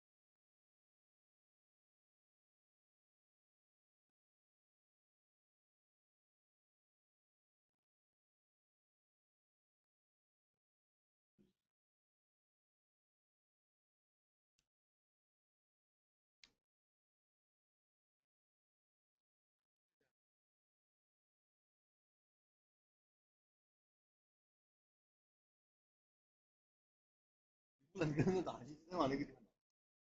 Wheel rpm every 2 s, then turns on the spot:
0, 0, 0, 0, 0, 0, 0, 0, 0, 0, 0, 0, 0, 0, 0.
none